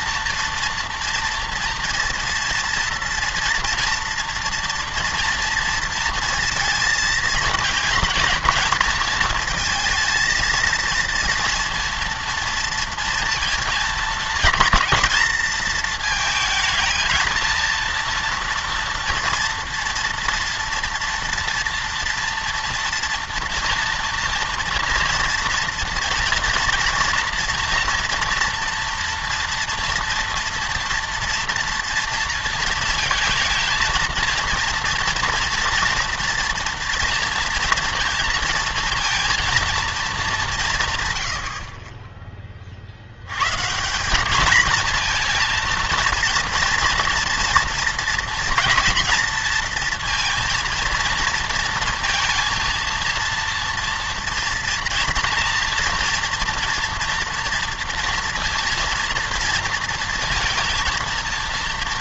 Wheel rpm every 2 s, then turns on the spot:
230, 230, 230, 230, 220, 230, 230, 220, 220, 230, 240, 230, 240, 230, 240, 230, 230, 230, 230, 230, 160, 50, 220, 230, 230, 230, 230, 230, 230, 230, 230.
none